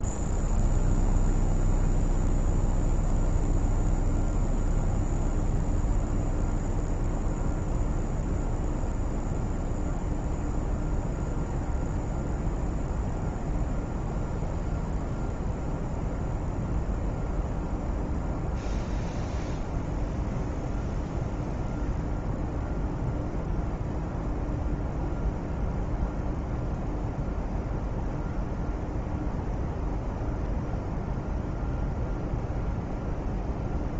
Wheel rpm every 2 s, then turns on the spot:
0, 0, 0, 0, 0, 0, 0, 0, 0, 0, 0, 0, 0, 0, 0, 0, 0.
none